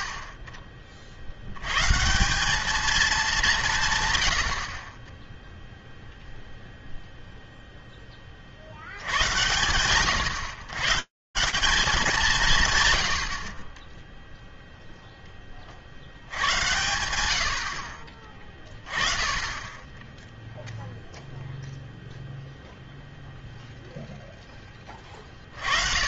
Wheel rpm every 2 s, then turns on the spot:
50, 210, 70, 0, 70, 150, 80, 10, 100, 20, 0, 0, 40.
none